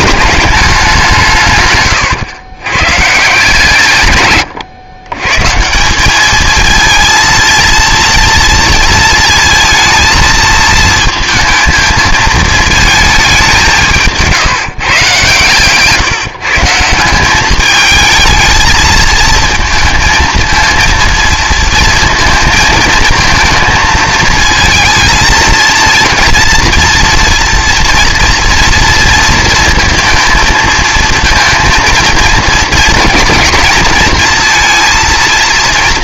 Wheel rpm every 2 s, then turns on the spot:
200, 110, 110, 220, 230, 230, 220, 150, 160, 220, 230, 230, 230, 240, 230, 230, 230, 230.
none